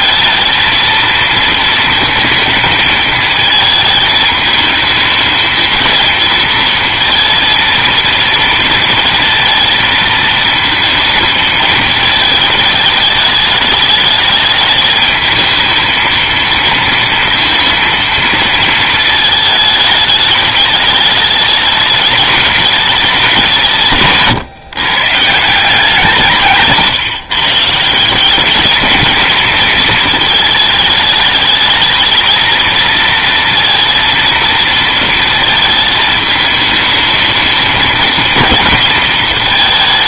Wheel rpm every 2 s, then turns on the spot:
230, 220, 220, 230, 230, 220, 220, 210, 230, 230, 210, 210, 140, 150, 210, 220, 220, 230, 220, 230.
none